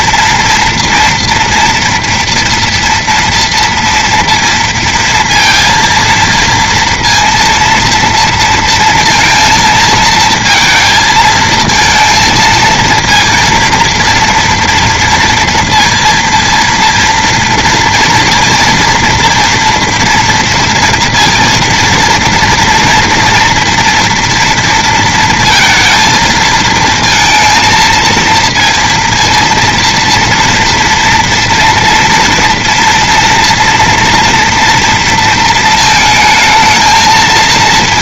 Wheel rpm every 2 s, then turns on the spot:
230, 230, 230, 230, 230, 220, 230, 230, 230, 230, 230, 230, 230, 230, 230, 230, 230, 230, 220.
none